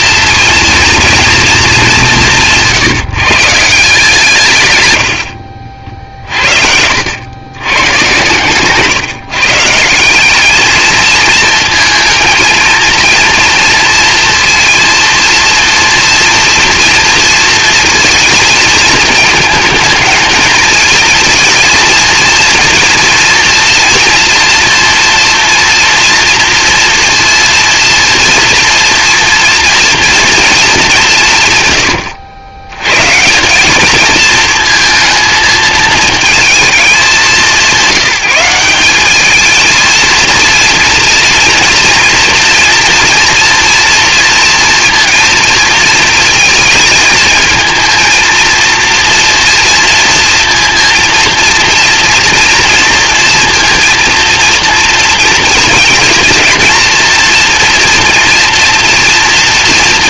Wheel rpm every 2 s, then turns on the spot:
230, 160, 120, 60, 140, 210, 230, 230, 230, 220, 220, 230, 230, 230, 230, 210, 110, 230, 220, 200, 230, 240, 240, 220, 240, 230, 230, 230, 230, 230.
none